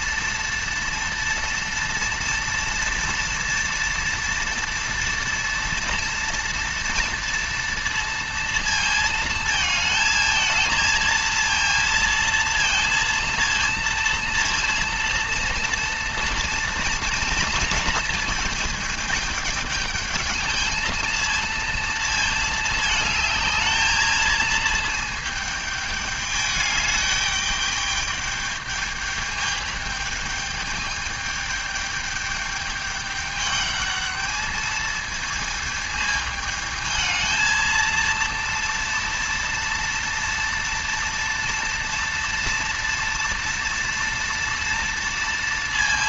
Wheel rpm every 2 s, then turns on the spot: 230, 230, 230, 230, 230, 220, 230, 230, 230, 220, 220, 220, 220, 210, 210, 210, 210, 220, 220, 230, 230, 230, 230.
none